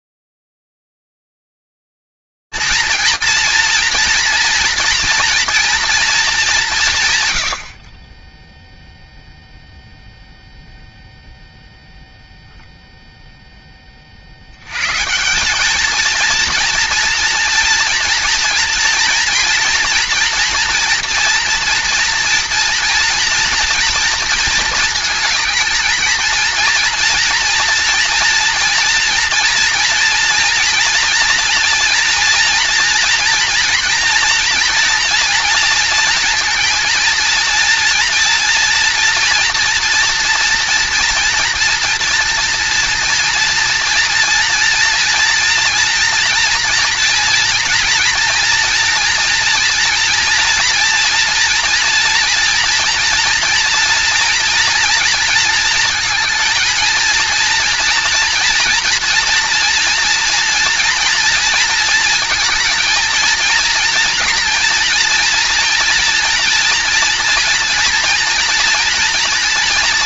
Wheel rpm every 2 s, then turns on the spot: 110, 230, 230, 210, 10, 0, 0, 150, 230, 240, 230, 230, 220, 230, 230, 230, 240, 230, 230, 230, 230, 230, 230, 230, 230, 230, 230, 230, 230, 230, 230, 230, 230, 230, 230.
none